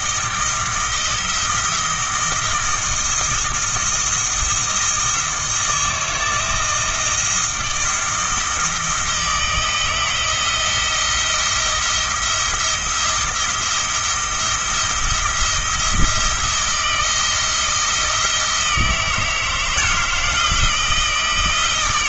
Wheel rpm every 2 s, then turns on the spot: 160, 160, 160, 160, 160, 160, 170, 170, 170, 160, 160.
none